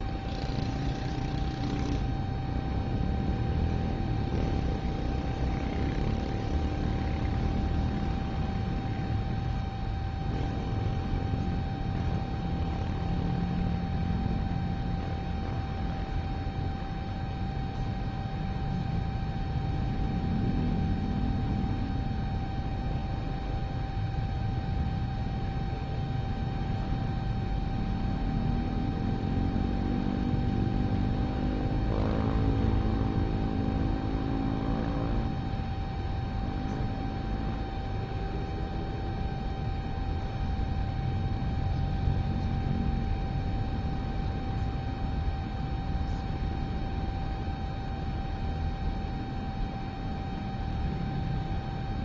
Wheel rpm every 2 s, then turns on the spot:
0, 0, 0, 0, 0, 0, 0, 0, 0, 0, 0, 0, 0, 0, 0, 0, 0, 0, 0, 0, 0, 0, 0, 0, 0, 0.
none